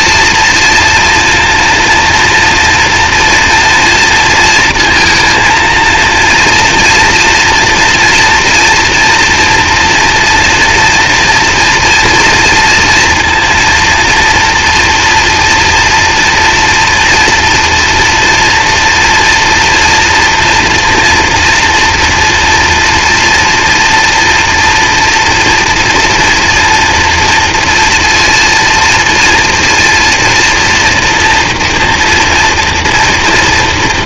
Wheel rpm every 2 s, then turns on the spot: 230, 230, 230, 230, 240, 230, 230, 230, 230, 230, 230, 230, 230, 230, 230, 230, 230.
none